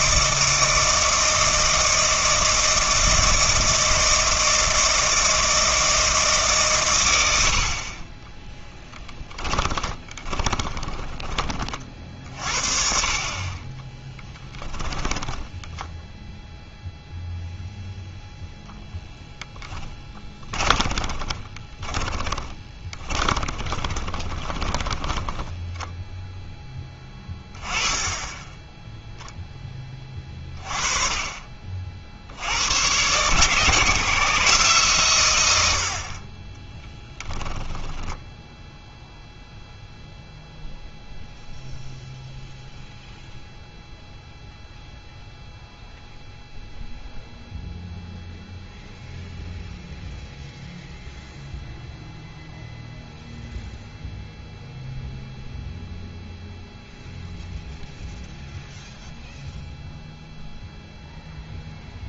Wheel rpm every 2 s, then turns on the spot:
160, 160, 160, 140, 10, 20, 40, 20, 0, 0, 20, 20, 20, 10, 10, 30, 80, 140, 20, 0, 0, 0, 0, 0, 0, 0, 0, 0, 0, 0, 0.
8-12 14-16 20-26 36-38